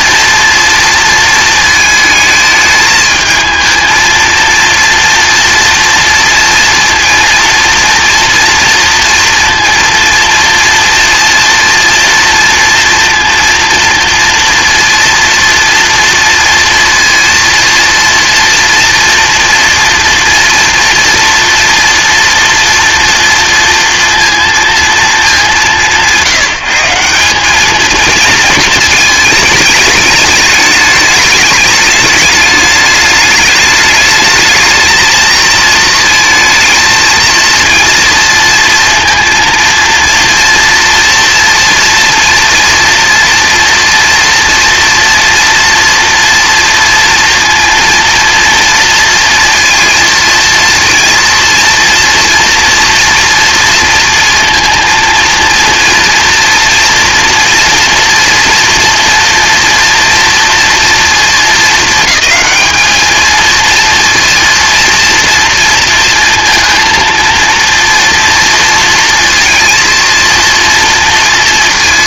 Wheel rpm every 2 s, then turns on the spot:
230, 220, 230, 230, 230, 230, 230, 230, 230, 240, 230, 230, 230, 170, 220, 210, 210, 220, 220, 230, 230, 230, 230, 230, 230, 230, 230, 230, 230, 240, 230, 210, 230, 230, 230, 230.
none